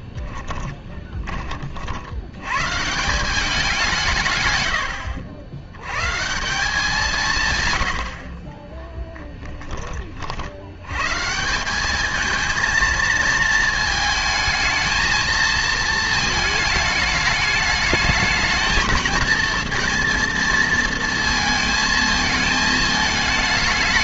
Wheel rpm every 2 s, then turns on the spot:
10, 130, 100, 180, 20, 80, 220, 220, 210, 220, 230, 220.
0-2